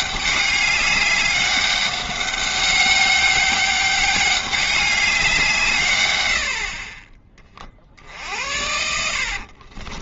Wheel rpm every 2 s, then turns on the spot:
200, 200, 200, 50, 80.
8-10